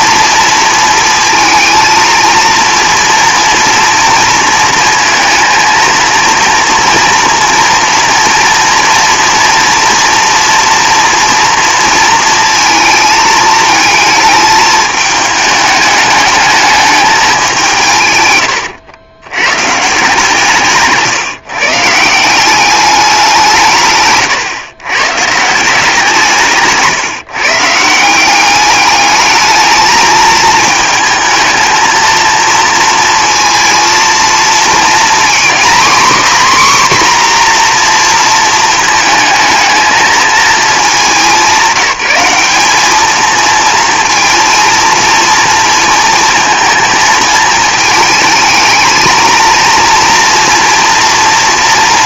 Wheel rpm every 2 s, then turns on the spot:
230, 230, 230, 240, 230, 230, 220, 210, 210, 110, 150, 200, 130, 150, 200, 220, 230, 230, 260, 220, 220, 210, 230, 220, 220, 230.
18-22